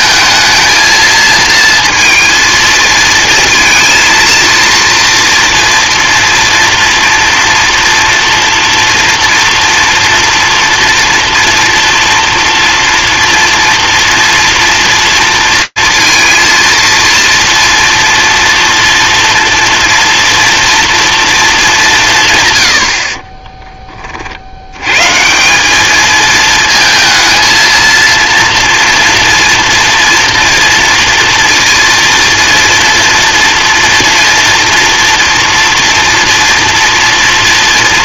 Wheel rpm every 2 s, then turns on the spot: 220, 230, 230, 230, 230, 230, 230, 230, 230, 230, 230, 100, 80, 220, 230, 230, 230, 230, 230.
none